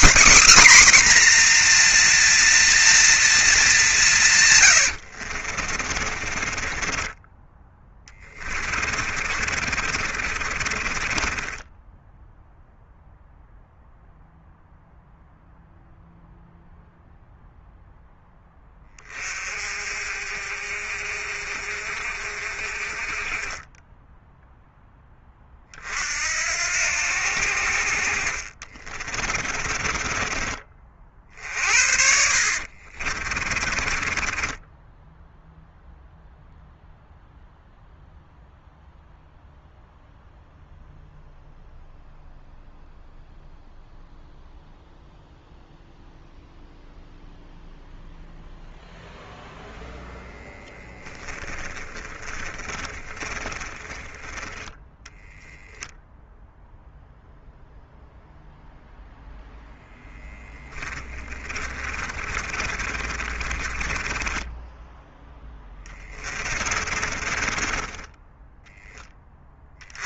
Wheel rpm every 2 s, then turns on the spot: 270, 240, 100, 30, 30, 30, 0, 0, 0, 20, 50, 40, 0, 70, 40, 40, 50, 10, 0, 0, 0, 0, 0, 0, 0, 10, 20, 10, 0, 0, 10, 30, 10, 40, 10.
4-12 28-30 32-36 50-54 60-68